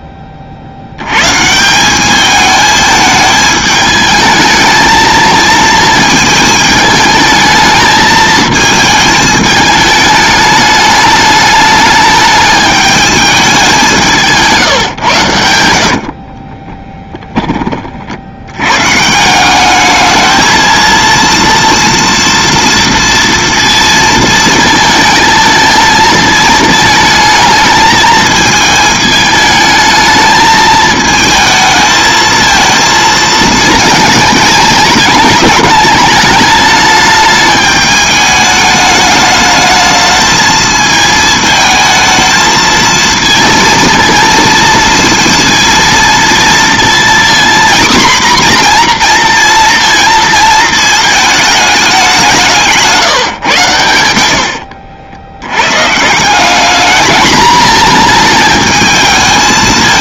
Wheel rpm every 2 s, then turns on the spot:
60, 220, 220, 220, 220, 210, 210, 140, 20, 110, 230, 230, 220, 220, 220, 220, 230, 220, 210, 210, 220, 220, 230, 230, 240, 220, 170, 70, 200, 220.
14-18 54-56